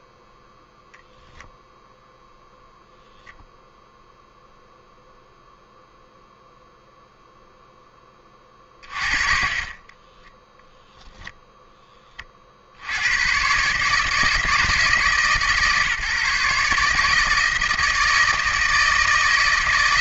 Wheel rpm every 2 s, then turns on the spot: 0, 0, 0, 0, 30, 0, 70, 160, 150, 160.
none